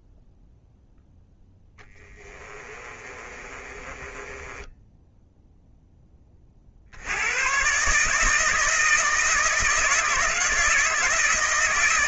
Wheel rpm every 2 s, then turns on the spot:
0, 30, 10, 90, 160, 160.
2-6